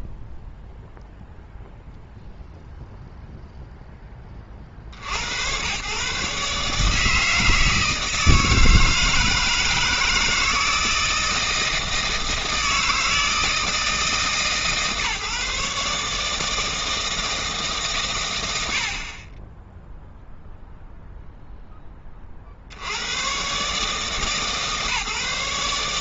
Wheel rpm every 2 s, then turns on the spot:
0, 0, 40, 150, 160, 160, 160, 140, 160, 70, 0, 50, 150.
none